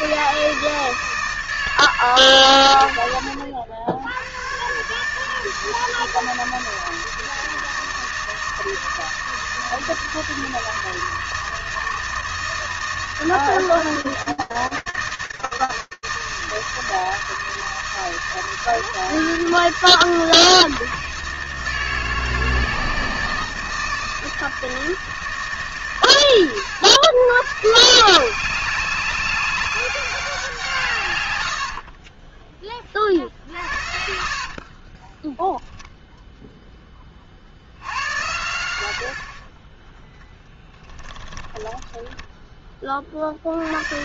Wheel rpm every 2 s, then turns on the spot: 160, 120, 120, 160, 160, 160, 160, 160, 160, 160, 160, 160, 160, 90, 190, 160, 20, 40, 20, 100, 10, 20.
34-36 40-42